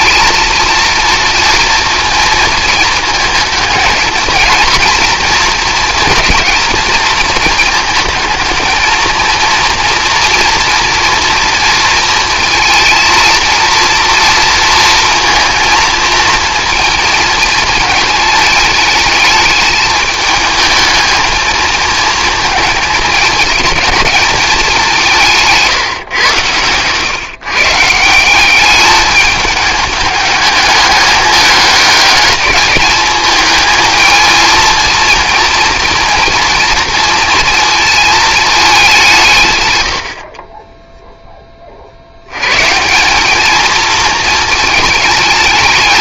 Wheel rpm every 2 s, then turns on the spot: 230, 220, 230, 220, 220, 230, 230, 230, 230, 220, 220, 220, 200, 110, 200, 210, 210, 230, 230, 200, 20, 140, 220.
none